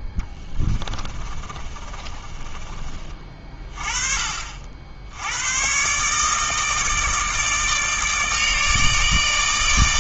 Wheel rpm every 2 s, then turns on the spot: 20, 30, 60, 160, 150.
0-4